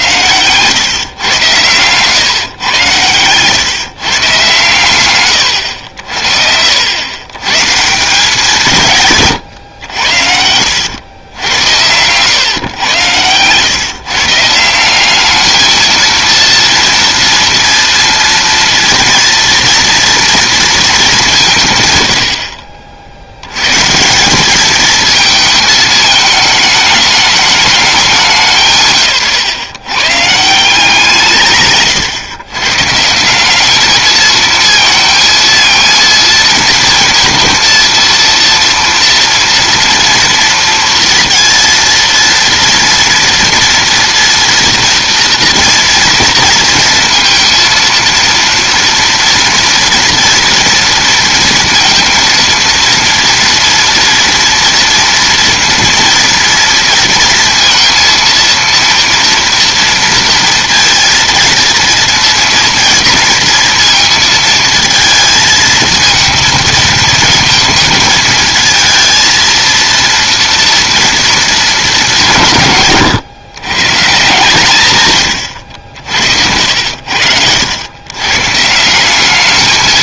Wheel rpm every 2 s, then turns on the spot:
120, 120, 130, 70, 170, 90, 110, 160, 230, 230, 230, 70, 200, 220, 160, 170, 130, 230, 230, 230, 230, 230, 240, 230, 230, 230, 230, 230, 230, 230, 230, 230, 230, 220, 220, 230, 160, 150, 80, 150.
76-78